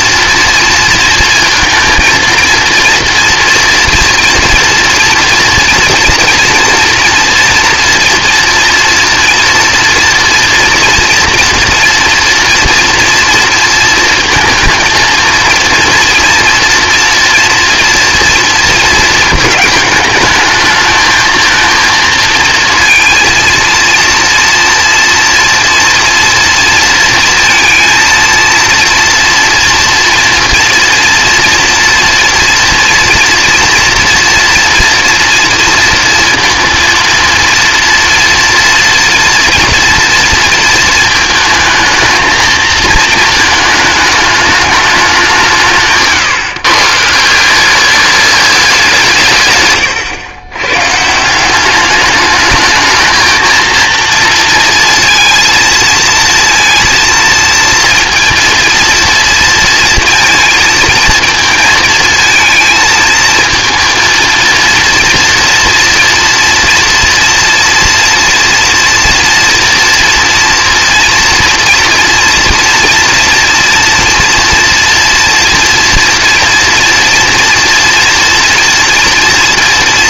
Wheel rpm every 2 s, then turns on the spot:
230, 230, 230, 230, 230, 230, 230, 230, 230, 230, 220, 230, 240, 230, 240, 230, 230, 230, 230, 230, 230, 220, 210, 140, 190, 130, 220, 230, 230, 230, 230, 220, 230, 230, 240, 230, 230, 240, 230, 230.
none